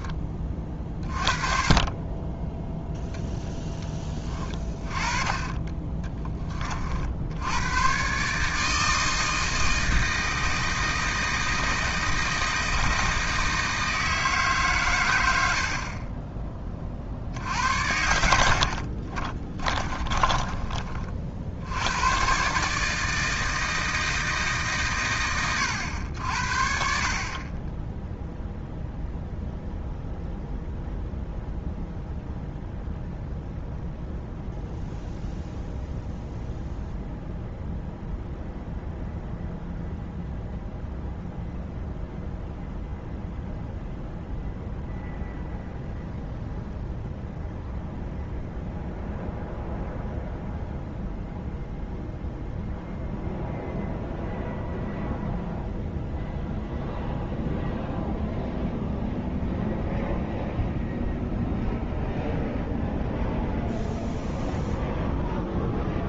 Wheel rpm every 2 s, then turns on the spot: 0, 30, 60, 160, 160, 160, 140, 20, 60, 20, 140, 150, 60, 0, 0, 0, 0, 0, 0, 0, 0, 0, 0, 0, 0, 0, 0, 0, 0, 0, 0, 0, 0.
16-18